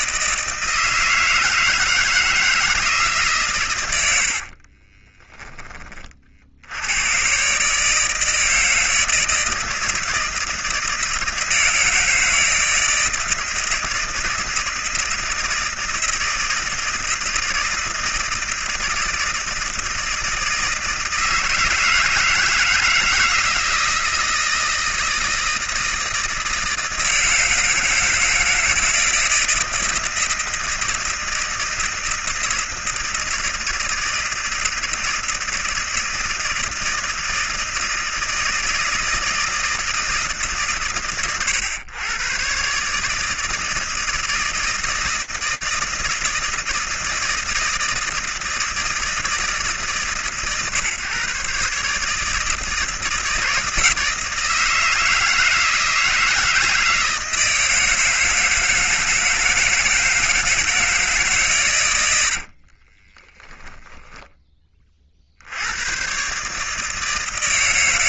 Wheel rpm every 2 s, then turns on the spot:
160, 160, 60, 70, 160, 160, 160, 160, 160, 160, 160, 160, 160, 160, 160, 160, 160, 160, 160, 160, 130, 120, 160, 160, 160, 140, 160, 160, 160, 160, 160, 50, 30, 160.
4-6 62-64